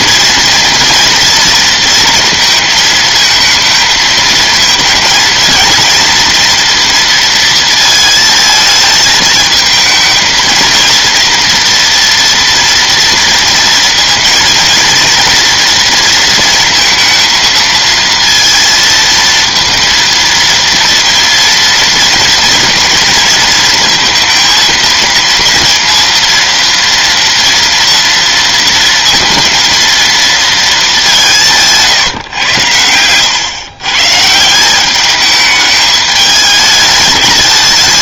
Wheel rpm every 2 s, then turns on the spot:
230, 230, 220, 230, 220, 230, 230, 230, 230, 230, 230, 230, 230, 230, 230, 220, 110, 160, 210.
none